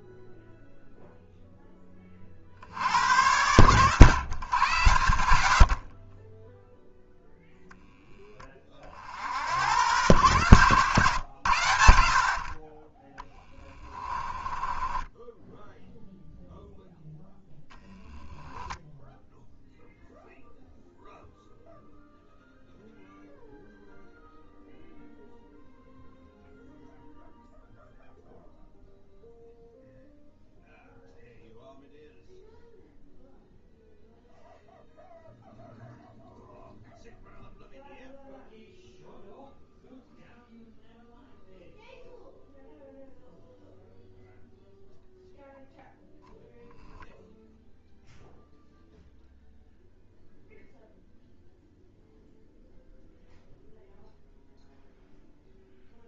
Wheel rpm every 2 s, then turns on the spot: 0, 70, 110, 0, 30, 110, 30, 20, 0, 0, 0, 0, 0, 0, 0, 0, 0, 0, 0, 0, 0, 0, 0, 0, 0, 0, 0, 0.
14-16